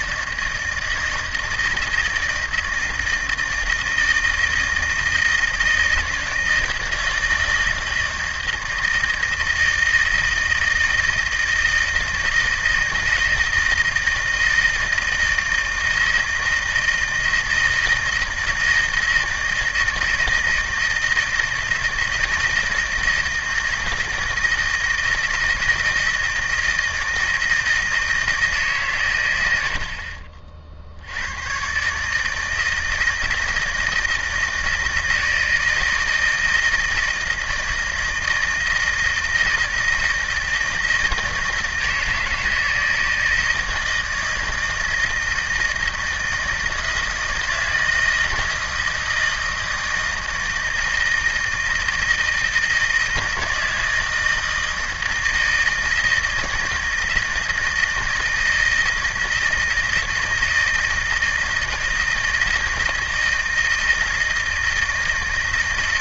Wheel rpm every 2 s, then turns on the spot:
160, 160, 160, 160, 160, 160, 160, 160, 160, 160, 160, 160, 160, 160, 140, 60, 160, 160, 160, 160, 160, 160, 160, 160, 160, 160, 160, 160, 160, 160, 160, 160, 160.
none